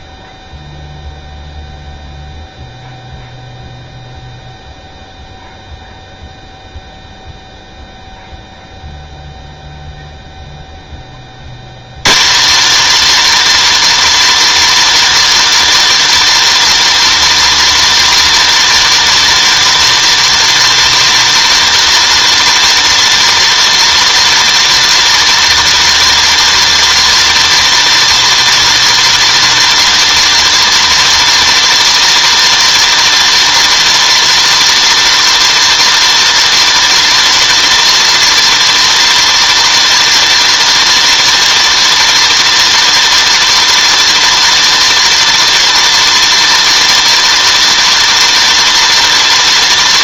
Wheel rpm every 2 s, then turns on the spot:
0, 0, 0, 0, 0, 150, 320, 320, 310, 320, 320, 320, 320, 320, 320, 320, 320, 320, 320, 320, 320, 320, 320, 310, 190.
none